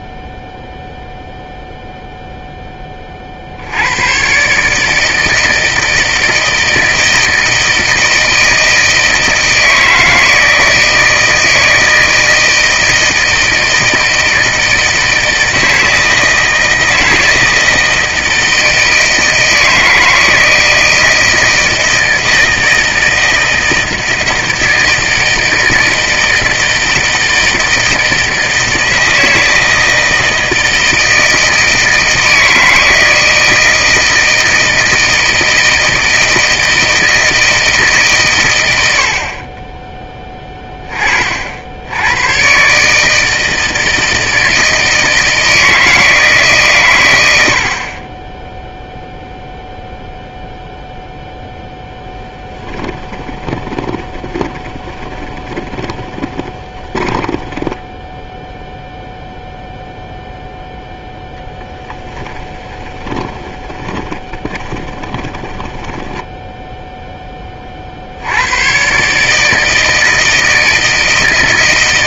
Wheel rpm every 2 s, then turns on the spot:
0, 10, 150, 160, 160, 160, 160, 160, 160, 160, 160, 160, 160, 160, 160, 160, 160, 160, 160, 110, 20, 140, 160, 140, 0, 0, 10, 20, 20, 0, 0, 20, 20, 10, 110, 160.
52-58 62-66